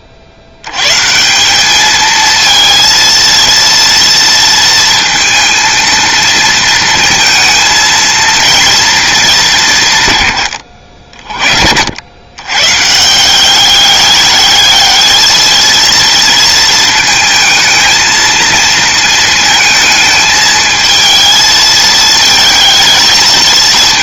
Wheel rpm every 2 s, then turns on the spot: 100, 230, 230, 230, 230, 80, 150, 210, 220, 230, 220, 220.
none